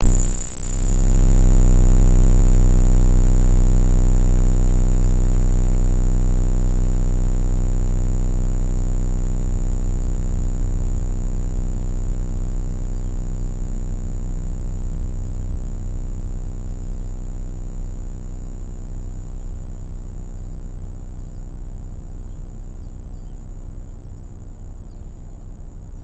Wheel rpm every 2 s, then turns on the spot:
0, 0, 0, 0, 0, 0, 0, 0, 0, 0, 0, 0, 0.
none